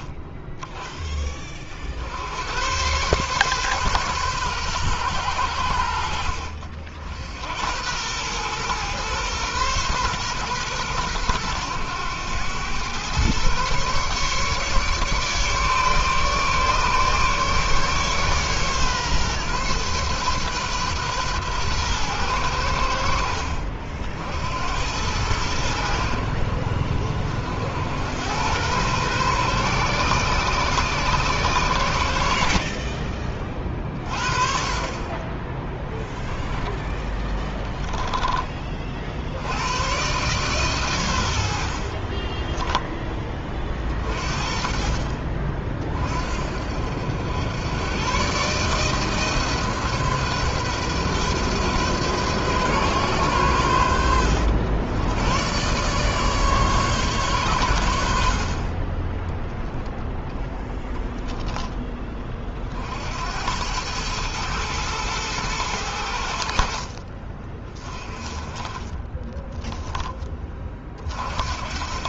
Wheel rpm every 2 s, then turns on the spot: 10, 100, 120, 50, 120, 120, 110, 150, 150, 140, 130, 90, 80, 70, 110, 130, 50, 40, 10, 30, 120, 10, 40, 60, 150, 130, 130, 90, 140, 50, 10, 50, 110, 60, 20, 30.
42-44